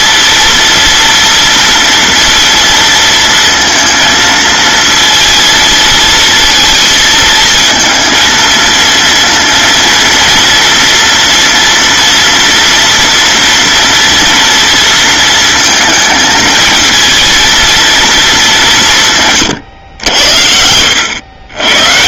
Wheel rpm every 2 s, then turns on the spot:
230, 230, 220, 220, 230, 230, 240, 230, 220, 180, 90.
none